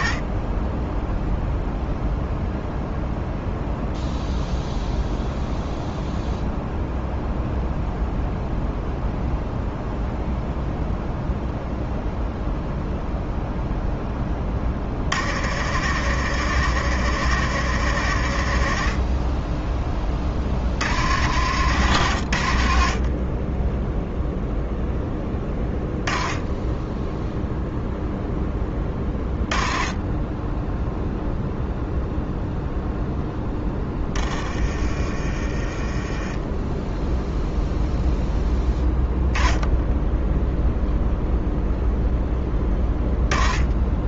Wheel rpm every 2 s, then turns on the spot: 10, 0, 0, 0, 0, 0, 0, 50, 110, 40, 70, 40, 0, 10, 20, 0, 0, 30, 10, 10, 0, 10.
34-36